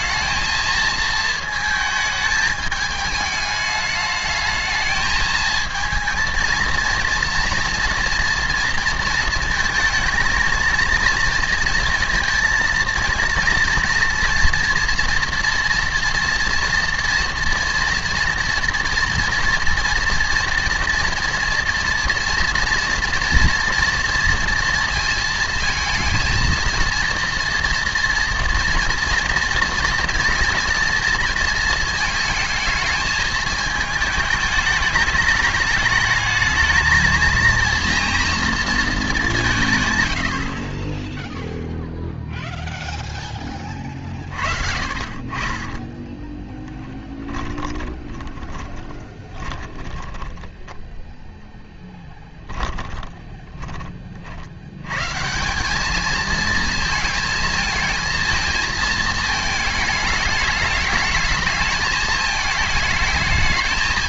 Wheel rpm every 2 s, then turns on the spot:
220, 210, 220, 230, 230, 230, 230, 240, 230, 230, 240, 230, 230, 230, 230, 230, 220, 210, 220, 220, 20, 0, 50, 10, 20, 10, 20, 100, 230, 220, 210, 220.
44-50 52-54